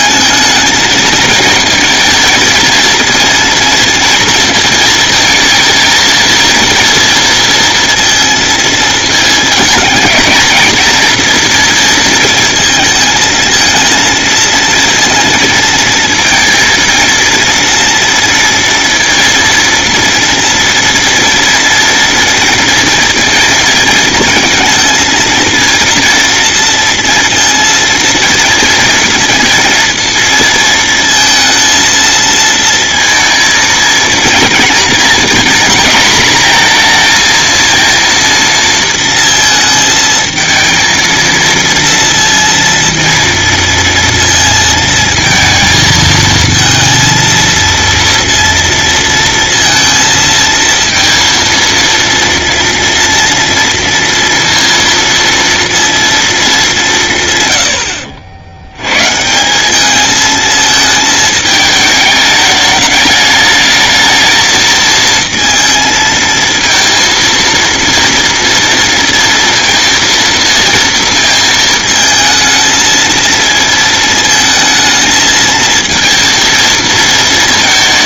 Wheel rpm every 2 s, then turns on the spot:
220, 230, 220, 230, 230, 230, 220, 230, 230, 230, 230, 230, 230, 230, 230, 230, 230, 230, 230, 230, 230, 230, 230, 230, 230, 230, 230, 230, 170, 120, 220, 210, 220, 230, 230, 230, 220, 220, 220.
none